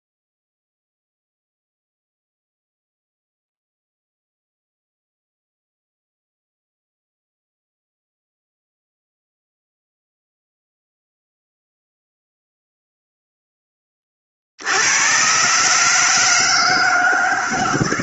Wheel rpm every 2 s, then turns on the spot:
0, 0, 0, 0, 0, 0, 0, 110, 160.
none